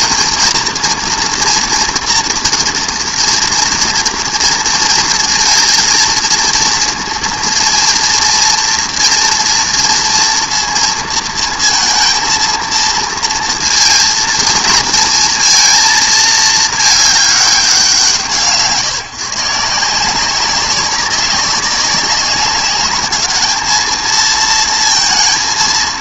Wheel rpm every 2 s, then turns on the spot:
240, 230, 230, 230, 230, 230, 230, 230, 220, 140, 190, 200, 230.
none